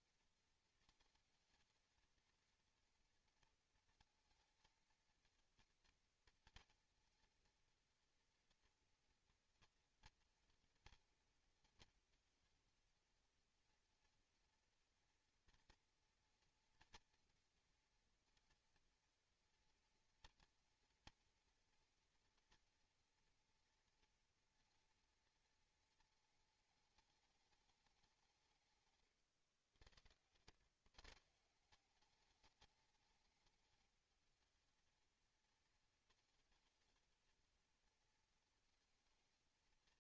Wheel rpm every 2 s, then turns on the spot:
230, 230, 230, 230, 230, 230, 230, 230, 230, 230, 230, 230, 230, 220, 140, 140, 210, 220, 220, 230.
none